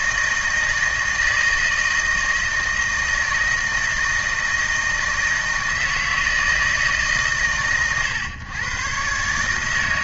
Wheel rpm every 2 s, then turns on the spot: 160, 160, 160, 150, 130.
none